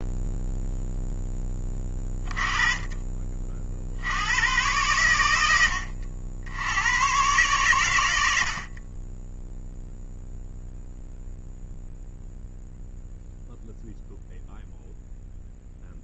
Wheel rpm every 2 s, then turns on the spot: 0, 20, 110, 90, 60, 0, 0, 0.
none